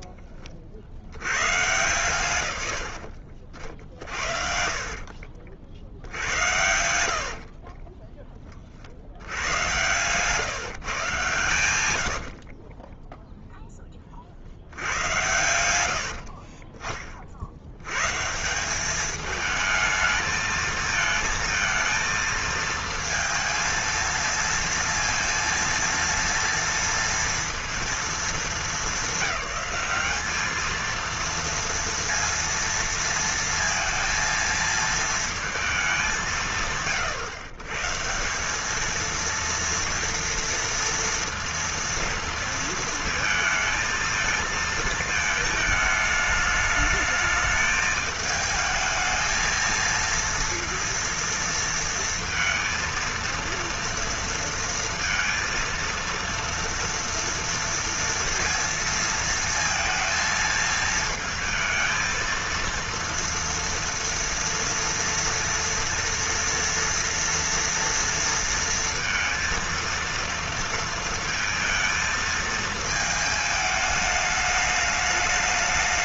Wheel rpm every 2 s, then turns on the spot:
20, 110, 50, 90, 30, 160, 40, 70, 50, 180, 220, 230, 230, 230, 200, 220, 230, 230, 150, 200, 230, 230, 230, 210, 220, 230, 230, 230, 230, 230, 220, 230, 240, 230, 230, 230, 220, 210.
4-8 12-14 16-18